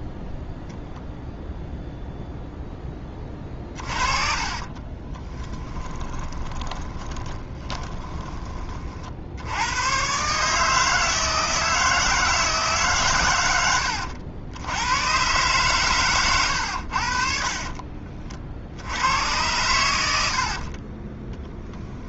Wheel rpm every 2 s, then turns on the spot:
0, 10, 40, 20, 30, 150, 150, 90, 90, 60, 50.
4-8 16-18 20-22